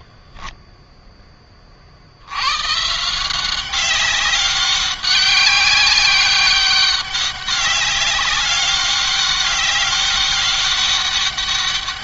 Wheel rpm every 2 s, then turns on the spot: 20, 120, 200, 190, 200, 200.
0-2